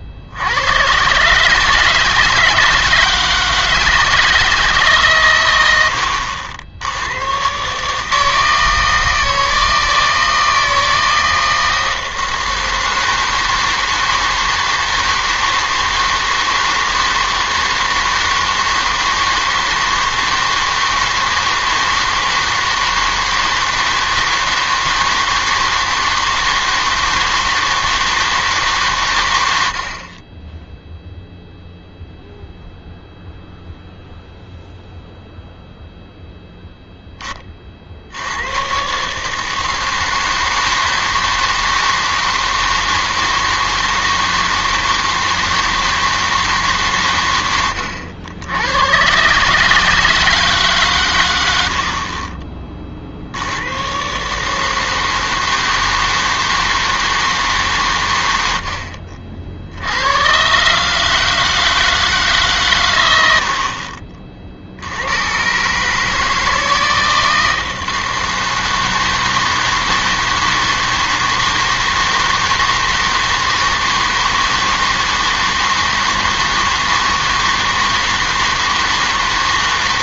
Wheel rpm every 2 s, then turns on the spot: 100, 160, 150, 80, 160, 160, 160, 160, 160, 160, 160, 160, 160, 160, 140, 10, 0, 0, 0, 110, 160, 160, 160, 150, 100, 140, 30, 150, 160, 80, 140, 120, 60, 160, 160, 160, 160, 160, 160, 160.
none